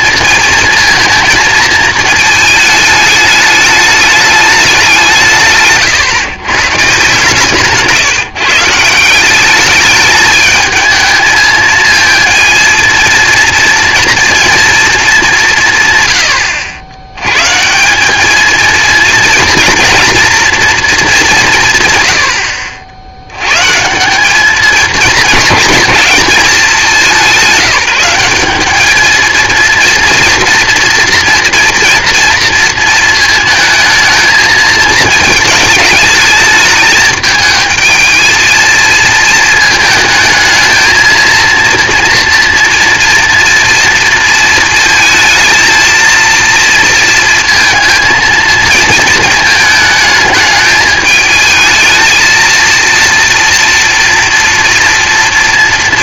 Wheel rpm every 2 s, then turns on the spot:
230, 220, 200, 130, 160, 220, 230, 230, 80, 220, 230, 70, 210, 200, 200, 230, 230, 220, 210, 230, 220, 240, 230, 230, 220, 210, 230, 230.
none